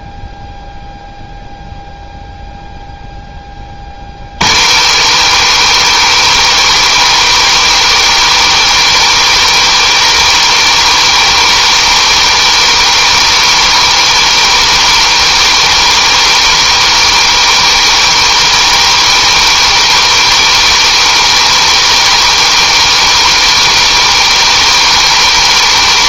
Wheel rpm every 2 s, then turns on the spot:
0, 0, 130, 170, 170, 170, 170, 170, 170, 170, 170, 170, 170.
none